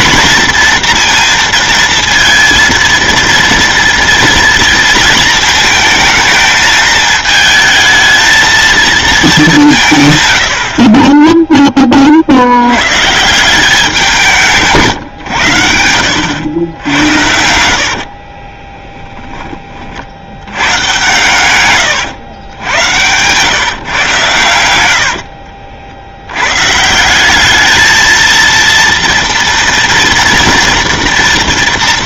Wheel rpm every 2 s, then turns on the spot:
230, 230, 230, 220, 220, 70, 80, 160, 90, 30, 110, 90, 90, 130, 230, 230.
18-20